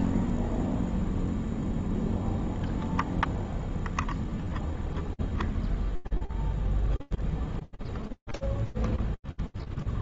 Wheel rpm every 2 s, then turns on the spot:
0, 0, 0, 0, 0.
none